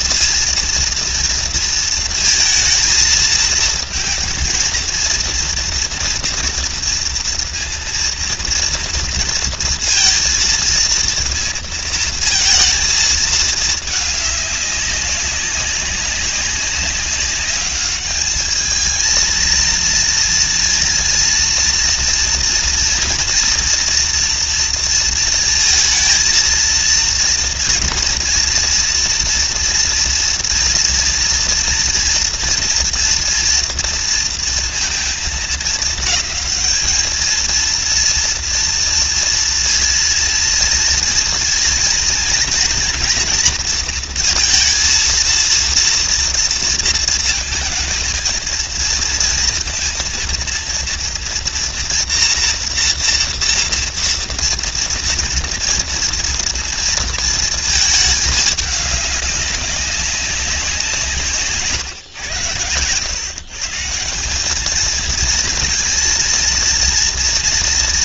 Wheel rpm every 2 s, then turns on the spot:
230, 230, 230, 230, 230, 230, 230, 210, 190, 210, 230, 230, 230, 230, 230, 230, 230, 230, 210, 230, 230, 230, 230, 230, 230, 240, 240, 230, 230, 210, 190, 110, 200, 230.
none